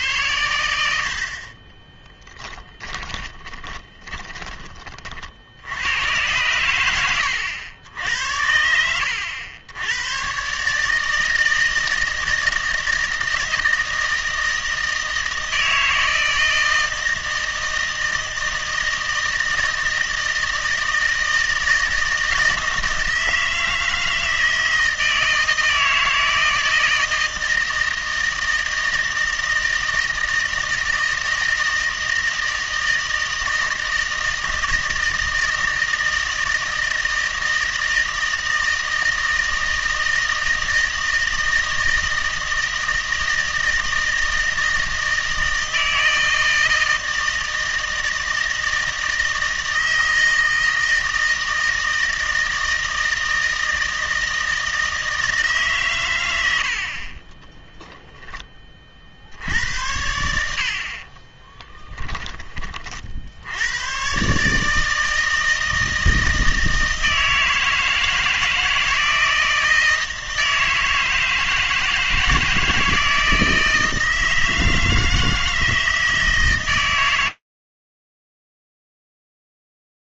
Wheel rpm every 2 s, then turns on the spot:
90, 10, 30, 110, 80, 140, 160, 160, 160, 160, 160, 160, 160, 160, 160, 160, 160, 160, 160, 160, 160, 160, 160, 160, 160, 160, 160, 160, 70, 30, 60, 40, 150, 160, 160, 160, 160, 160, 140, 0.
2-4